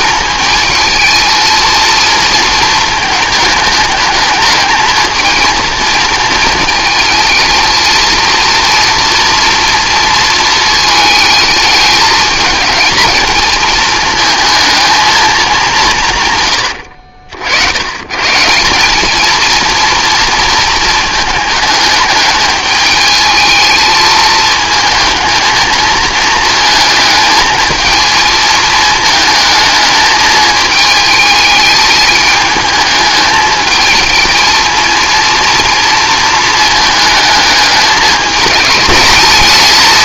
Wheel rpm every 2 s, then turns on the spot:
220, 230, 210, 230, 230, 230, 220, 220, 140, 140, 230, 210, 220, 220, 220, 220, 210, 230, 230, 220.
none